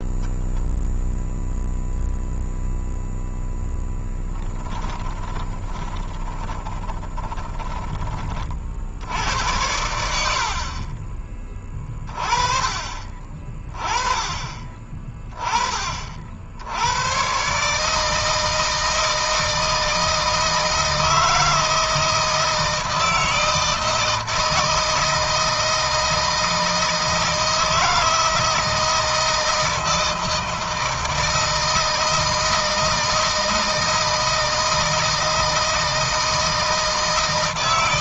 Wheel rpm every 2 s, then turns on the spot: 0, 0, 10, 20, 70, 40, 30, 30, 100, 160, 160, 160, 160, 160, 160, 160, 160, 160, 160.
4-8